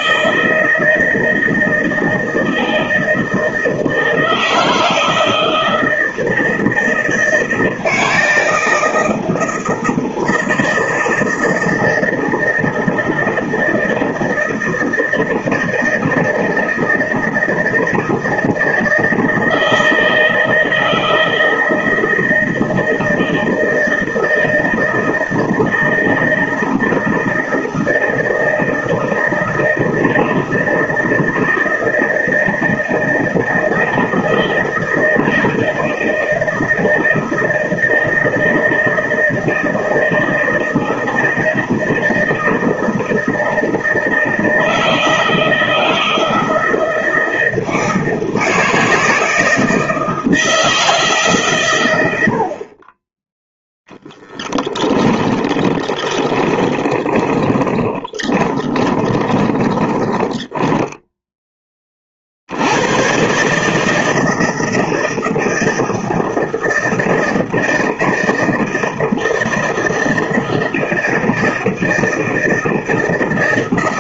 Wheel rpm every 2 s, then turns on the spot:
160, 160, 160, 160, 160, 160, 160, 160, 160, 160, 160, 160, 160, 160, 160, 160, 160, 160, 160, 160, 160, 160, 160, 160, 160, 160, 50, 10, 20, 20, 10, 70, 160, 160, 160, 160, 160.
54-62